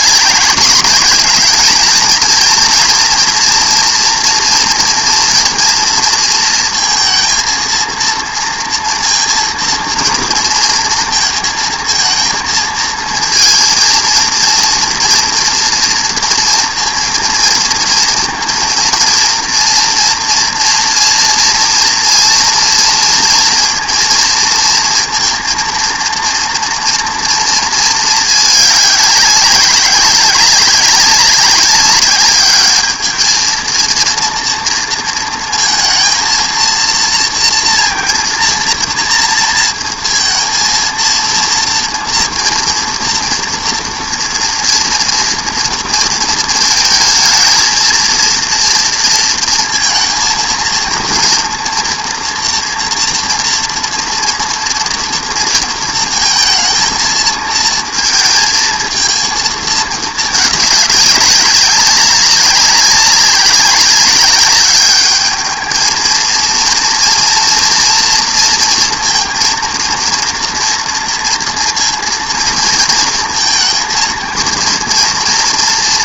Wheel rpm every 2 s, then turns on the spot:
200, 240, 240, 230, 230, 230, 220, 240, 230, 230, 230, 230, 230, 230, 210, 200, 210, 230, 230, 230, 230, 230, 230, 220, 230, 230, 240, 230, 220, 220, 210, 200, 200, 230, 230, 230, 230, 230.
none